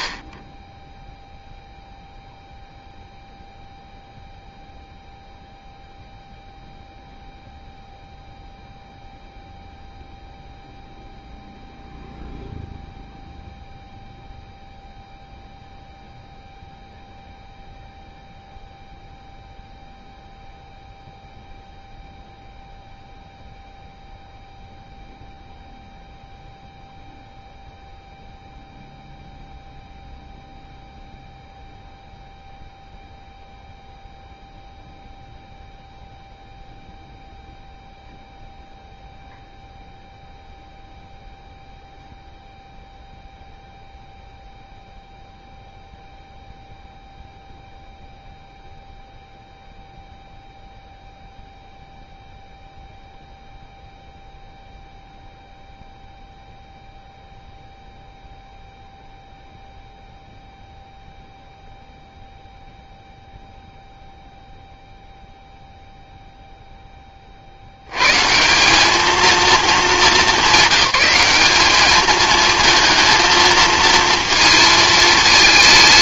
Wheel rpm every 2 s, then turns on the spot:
10, 0, 0, 0, 0, 0, 0, 0, 0, 0, 0, 0, 0, 0, 0, 0, 0, 0, 0, 0, 0, 0, 0, 0, 0, 0, 0, 0, 0, 0, 0, 0, 0, 10, 190, 210, 220, 220.
none